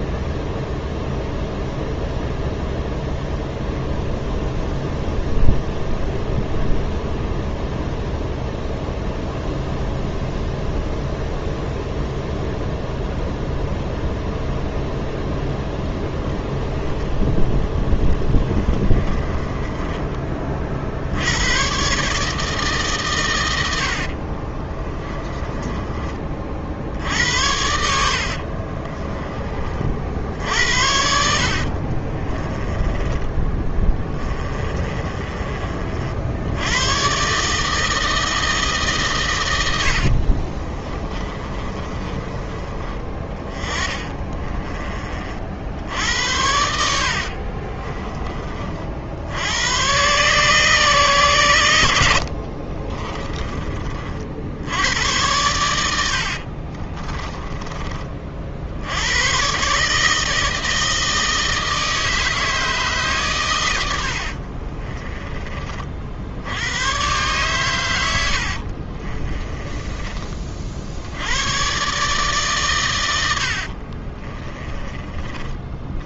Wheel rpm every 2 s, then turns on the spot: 0, 0, 0, 0, 0, 0, 0, 0, 0, 20, 50, 140, 20, 70, 40, 80, 20, 30, 110, 140, 30, 30, 30, 70, 50, 130, 30, 90, 30, 80, 160, 150, 30, 110, 40, 70, 110, 30.
18-20 24-26 28-36 40-42 46-48 52-54 56-58 64-66 68-70